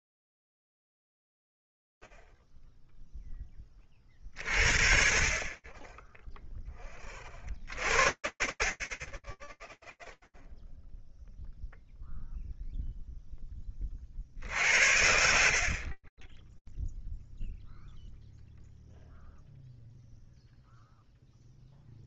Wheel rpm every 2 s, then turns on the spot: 0, 0, 20, 20, 20, 0, 0, 80, 0, 0, 0.
none